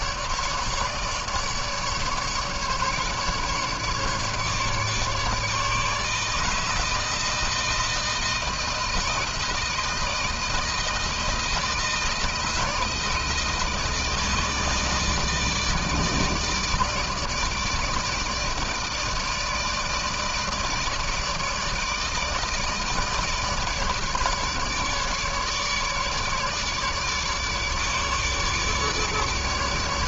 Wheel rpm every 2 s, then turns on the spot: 150, 150, 150, 160, 160, 160, 160, 160, 150, 160, 160, 160, 150, 150, 150.
none